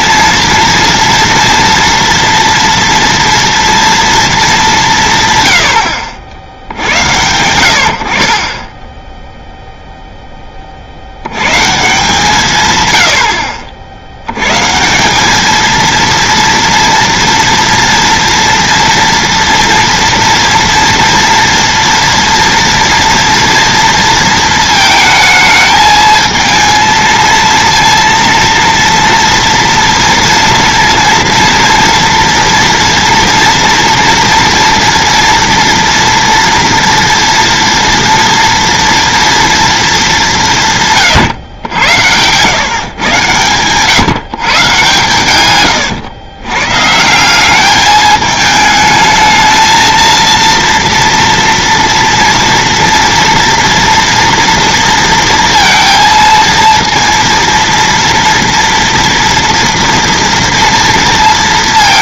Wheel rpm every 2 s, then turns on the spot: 230, 230, 200, 80, 20, 40, 140, 130, 230, 230, 230, 230, 220, 220, 230, 230, 230, 230, 230, 230, 170, 130, 140, 130, 220, 230, 240, 230, 230, 230, 230.
none